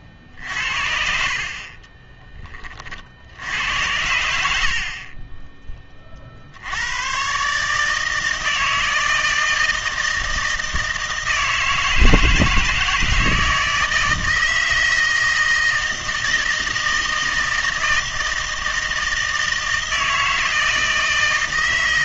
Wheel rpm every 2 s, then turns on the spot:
50, 40, 60, 80, 160, 160, 160, 160, 160, 160, 160.
none